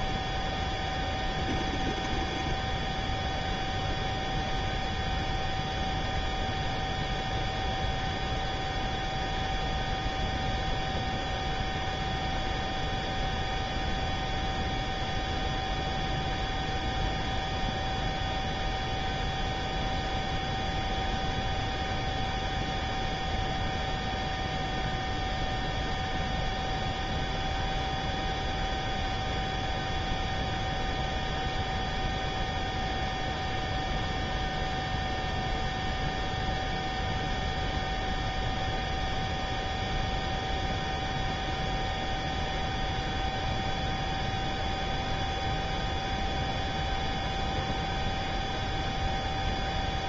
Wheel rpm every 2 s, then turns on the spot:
0, 0, 0, 0, 0, 0, 0, 0, 0, 0, 0, 0, 0, 0, 0, 0, 0, 0, 0, 0, 0, 0, 0, 0, 0.
none